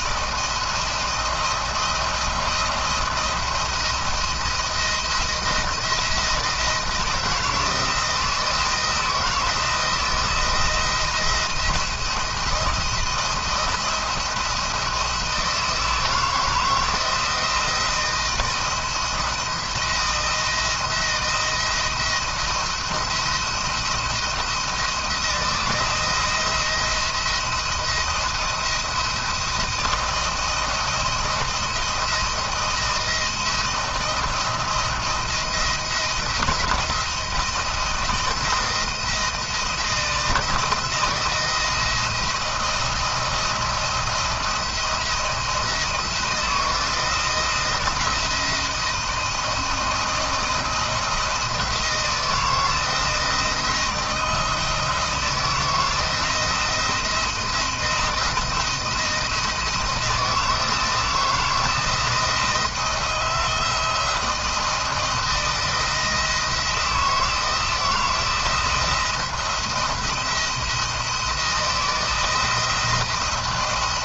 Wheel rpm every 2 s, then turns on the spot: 170, 170, 170, 160, 160, 170, 170, 170, 160, 170, 170, 170, 170, 170, 170, 170, 170, 170, 170, 170, 160, 170, 170, 160, 170, 170, 160, 160, 170, 170, 160, 170, 170, 170, 170, 170, 160.
none